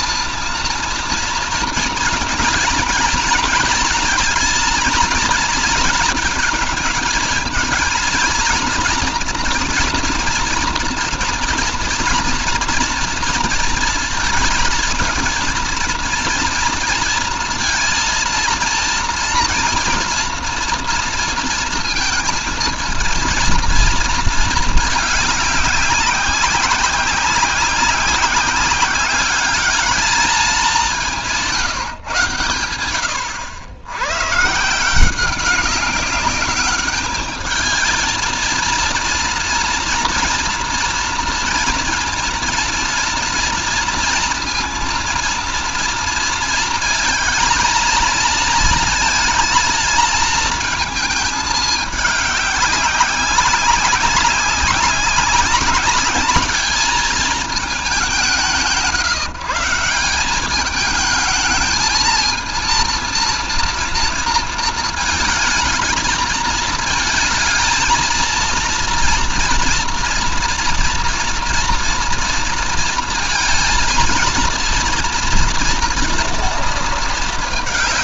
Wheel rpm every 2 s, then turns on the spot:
230, 230, 230, 220, 240, 240, 230, 230, 230, 230, 230, 230, 210, 190, 200, 170, 80, 170, 210, 230, 230, 230, 230, 230, 230, 220, 200, 190, 220, 170, 210, 230, 220, 220, 230, 240, 230, 230, 220.
none